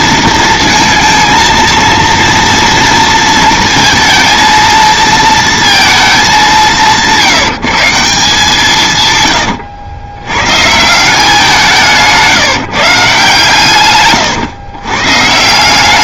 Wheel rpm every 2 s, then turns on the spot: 230, 230, 220, 190, 160, 140, 150, 120.
none